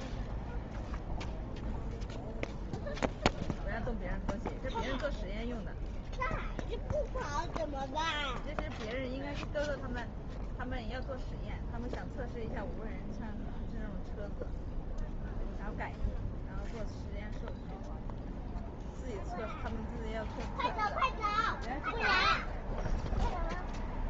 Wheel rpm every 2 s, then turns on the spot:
0, 0, 0, 0, 0, 0, 0, 0, 0, 0, 0, 0.
none